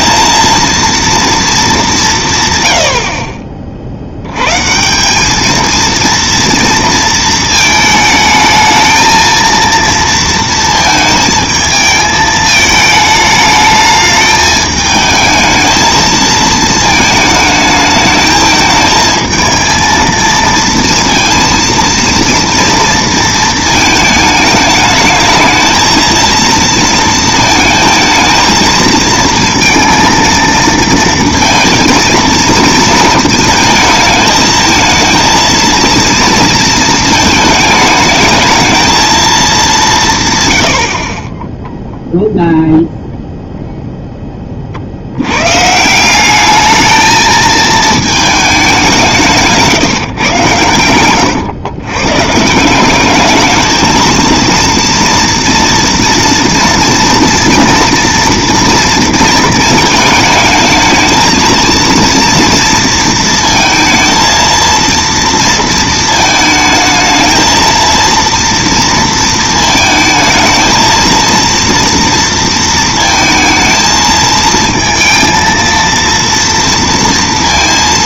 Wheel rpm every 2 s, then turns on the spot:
230, 130, 140, 230, 220, 230, 220, 210, 220, 220, 230, 230, 220, 230, 220, 230, 230, 220, 230, 220, 100, 0, 30, 220, 200, 110, 170, 230, 230, 230, 220, 230, 230, 220, 230, 220, 230, 220, 230.
none